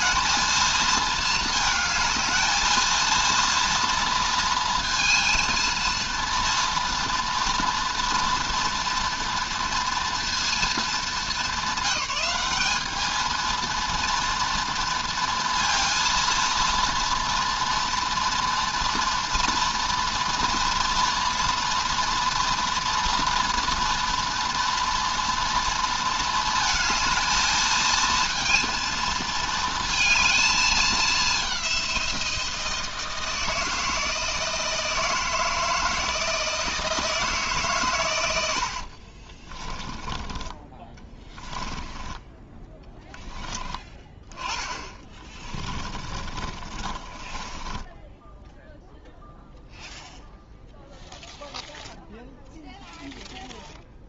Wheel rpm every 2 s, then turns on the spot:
220, 220, 230, 230, 230, 230, 210, 230, 230, 230, 230, 230, 230, 220, 230, 210, 160, 160, 160, 70, 20, 20, 20, 30, 0, 0, 0.
38-42 44-48